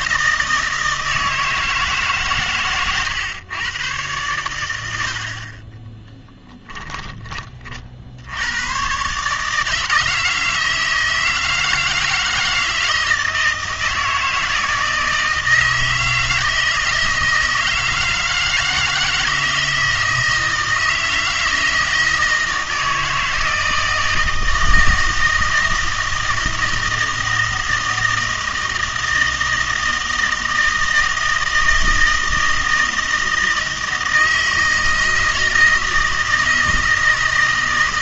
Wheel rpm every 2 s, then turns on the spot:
160, 120, 90, 10, 110, 160, 160, 160, 160, 160, 160, 160, 160, 160, 160, 160, 160, 160, 160.
6-8